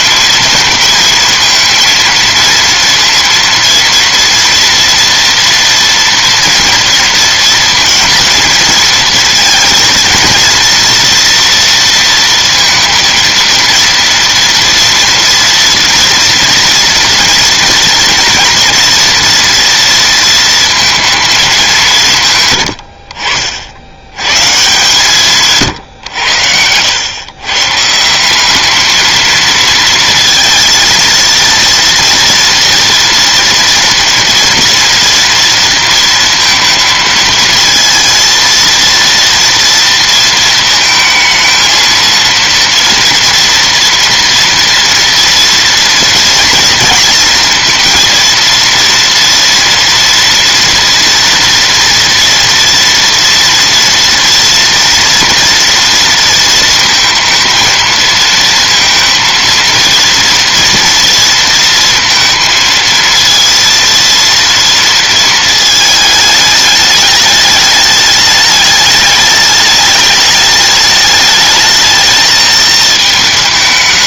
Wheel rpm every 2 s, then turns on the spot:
230, 230, 230, 230, 230, 240, 220, 230, 230, 230, 220, 60, 150, 100, 220, 230, 230, 230, 220, 230, 220, 230, 230, 230, 240, 230, 240, 230, 220, 230, 230, 230, 230, 210, 210, 210, 220.
none